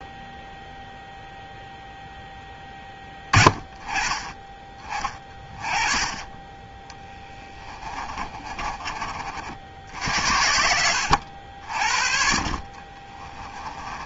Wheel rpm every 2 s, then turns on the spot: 0, 10, 20, 20, 30, 70, 50.
6-14